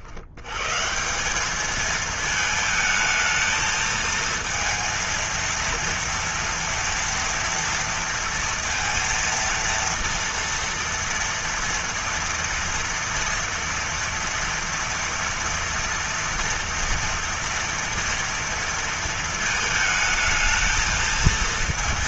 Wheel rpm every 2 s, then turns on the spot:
120, 220, 230, 230, 230, 230, 230, 230, 230, 230, 220.
none